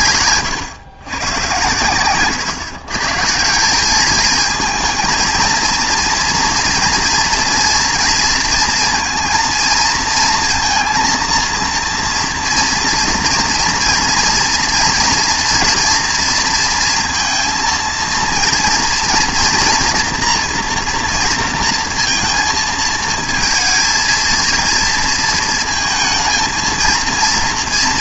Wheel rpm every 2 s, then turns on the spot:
130, 120, 220, 230, 230, 230, 230, 230, 230, 230, 240, 220, 230, 230.
none